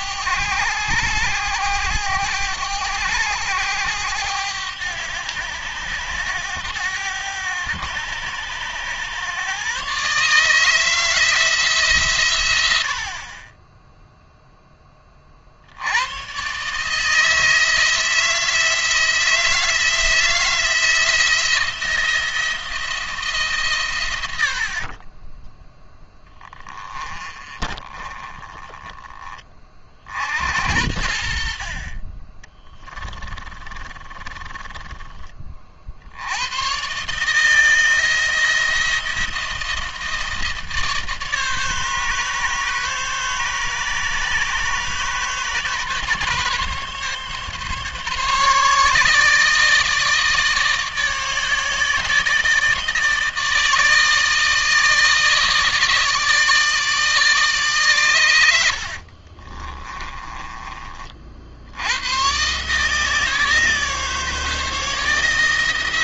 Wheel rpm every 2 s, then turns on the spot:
100, 100, 100, 100, 110, 160, 90, 10, 140, 160, 170, 170, 50, 20, 20, 80, 30, 20, 120, 170, 150, 140, 140, 140, 150, 150, 150, 160, 160, 70, 40, 150, 160.
32-36 58-60